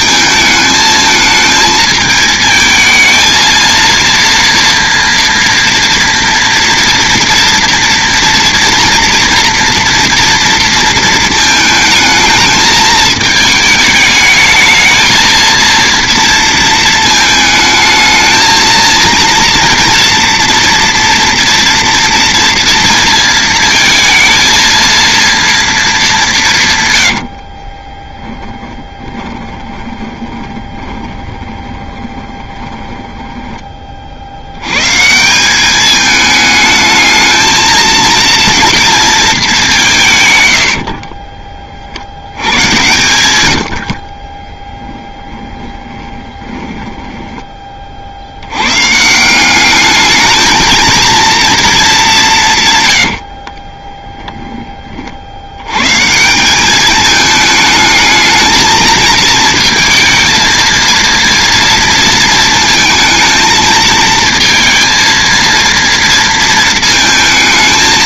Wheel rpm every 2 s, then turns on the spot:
220, 220, 230, 230, 230, 230, 220, 220, 230, 230, 230, 230, 230, 150, 10, 20, 20, 100, 220, 230, 80, 100, 10, 10, 110, 220, 130, 30, 200, 230, 230, 220, 230, 220.
28-34 40-48